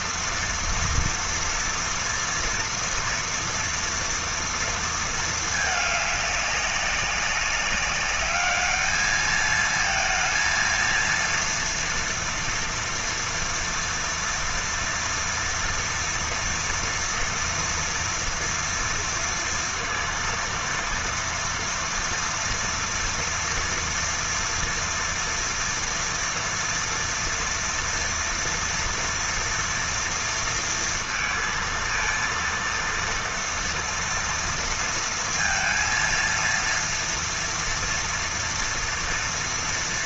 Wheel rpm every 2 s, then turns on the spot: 230, 230, 220, 200, 210, 230, 230, 230, 230, 230, 230, 230, 230, 240, 230, 230, 230, 230, 230, 230.
none